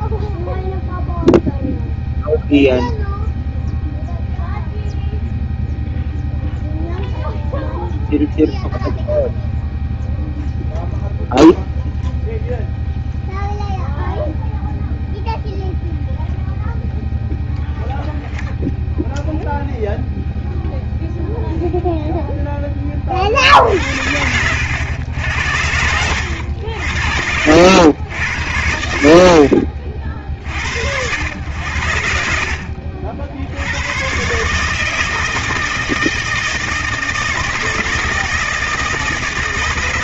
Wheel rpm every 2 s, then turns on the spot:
0, 0, 0, 0, 0, 0, 0, 0, 0, 0, 0, 20, 90, 70, 80, 80, 60, 150, 160, 160.
none